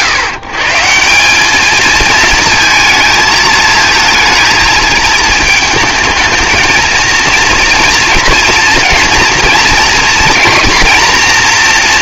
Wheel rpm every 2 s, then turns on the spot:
150, 230, 220, 230, 230, 240.
none